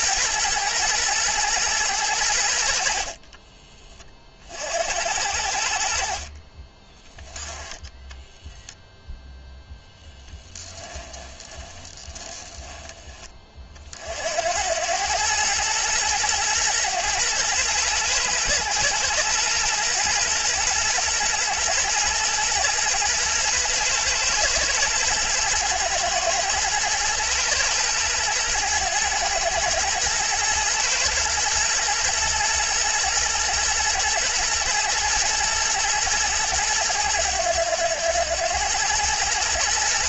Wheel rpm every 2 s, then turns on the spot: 110, 50, 60, 20, 10, 20, 20, 100, 110, 110, 110, 110, 120, 110, 110, 110, 120, 110, 100, 110.
2-4 10-12